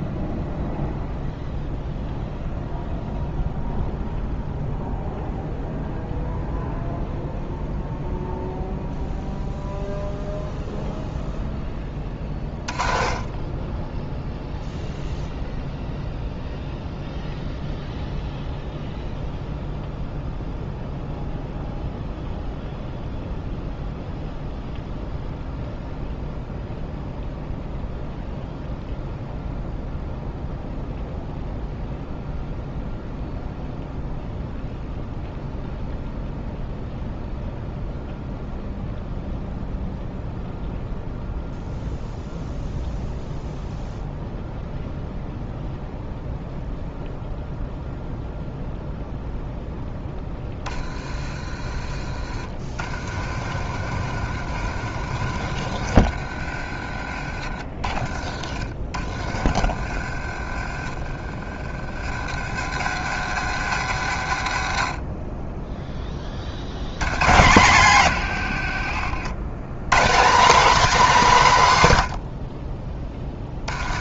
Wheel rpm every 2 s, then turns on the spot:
0, 0, 0, 0, 0, 0, 20, 0, 0, 0, 0, 0, 0, 0, 0, 0, 0, 0, 0, 0, 0, 0, 0, 0, 0, 30, 50, 70, 40, 50, 30, 100, 50, 90, 70, 240, 30.
72-74